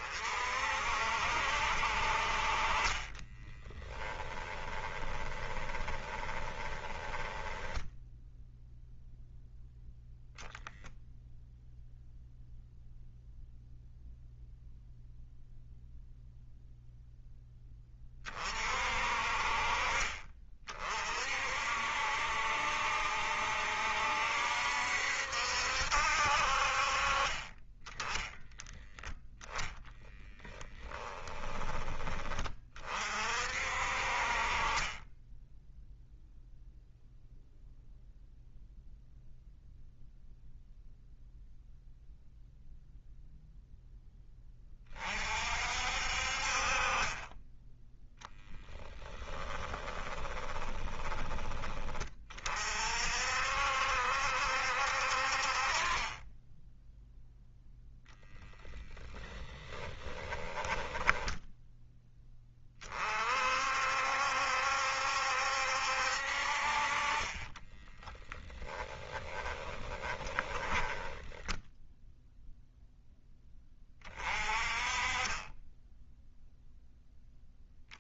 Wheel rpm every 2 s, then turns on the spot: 60, 30, 20, 20, 0, 0, 0, 0, 0, 40, 50, 70, 70, 40, 10, 10, 40, 20, 0, 0, 0, 0, 40, 40, 10, 20, 50, 60, 0, 10, 10, 40, 70, 40, 10, 20, 0, 30, 0.
2-8 30-32 48-52 60-62 68-72